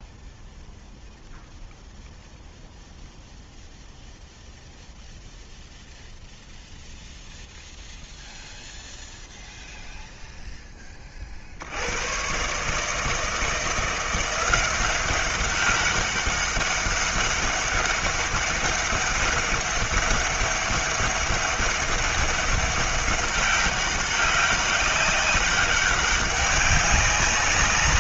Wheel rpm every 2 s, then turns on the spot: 0, 0, 0, 0, 0, 20, 140, 190, 200, 200, 200, 200, 200, 190.
none